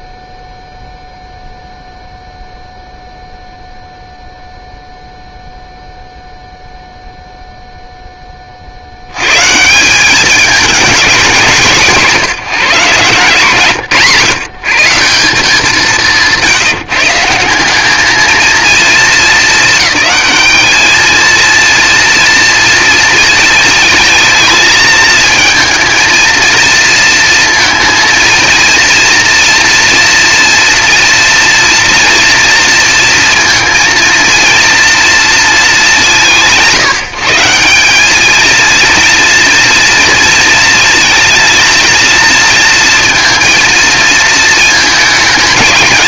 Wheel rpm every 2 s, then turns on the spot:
0, 0, 0, 0, 70, 210, 150, 170, 170, 220, 220, 220, 220, 230, 230, 230, 230, 230, 160, 230, 230, 230, 220.
none